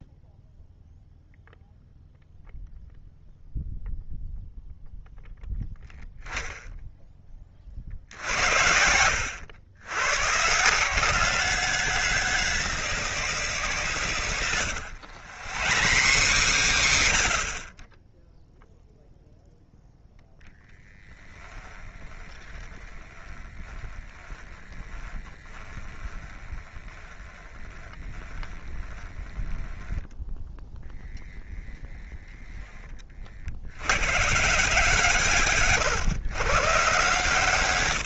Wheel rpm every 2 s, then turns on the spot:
0, 0, 0, 10, 90, 180, 190, 100, 100, 0, 10, 20, 20, 20, 20, 10, 40, 160, 150.
14-18 20-32